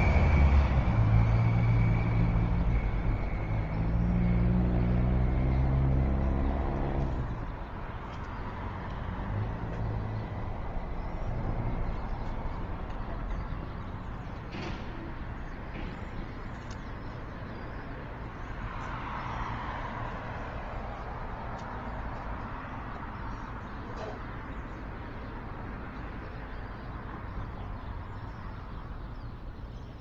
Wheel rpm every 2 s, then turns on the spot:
0, 0, 0, 0, 0, 0, 0, 0, 0, 0, 0, 0, 0, 0, 0.
none